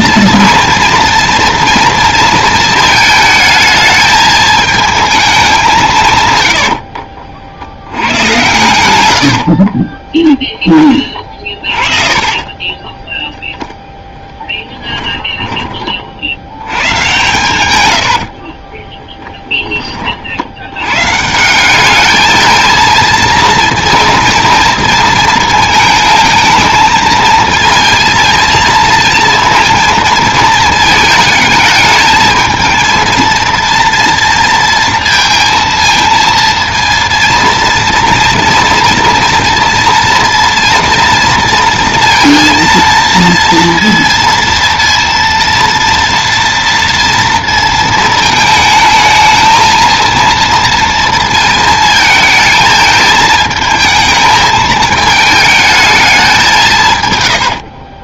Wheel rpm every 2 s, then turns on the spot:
230, 220, 220, 70, 110, 20, 10, 10, 110, 20, 120, 230, 220, 220, 230, 220, 230, 230, 230, 240, 230, 230, 230, 230, 220, 230, 220, 220, 130.
6-8 10-16 18-20